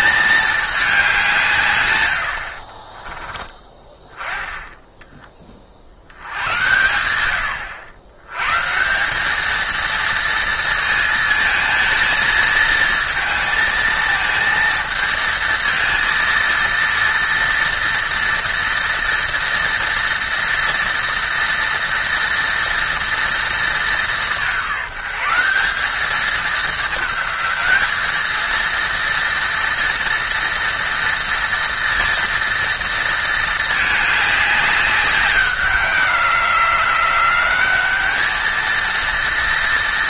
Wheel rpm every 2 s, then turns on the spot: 210, 40, 20, 90, 150, 230, 220, 230, 230, 230, 230, 230, 180, 210, 230, 230, 230, 200, 170, 230.
2-4